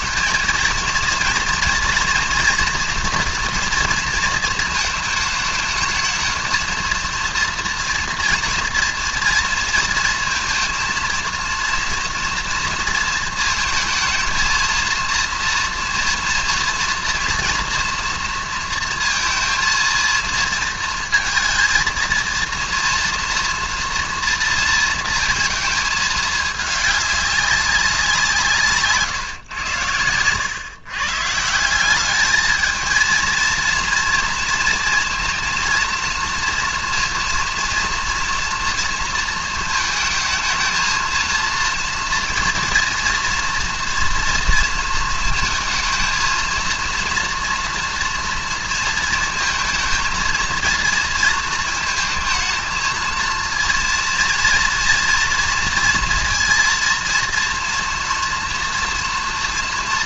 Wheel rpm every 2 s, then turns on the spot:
230, 230, 220, 220, 230, 230, 230, 220, 230, 230, 230, 230, 230, 210, 150, 130, 220, 230, 240, 230, 220, 240, 230, 230, 230, 230, 230, 230, 230, 240.
none